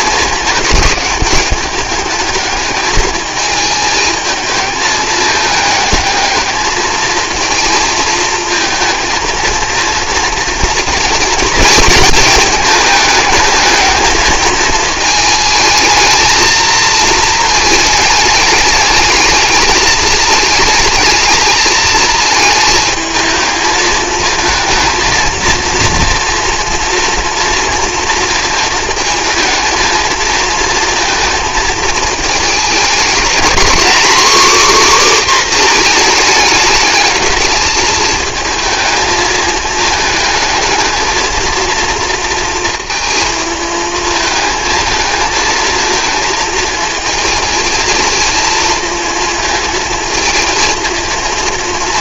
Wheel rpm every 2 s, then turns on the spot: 210, 220, 220, 220, 220, 230, 220, 220, 230, 210, 220, 220, 220, 230, 220, 230, 220, 270, 220, 220, 220, 230, 220, 220, 220, 220.
none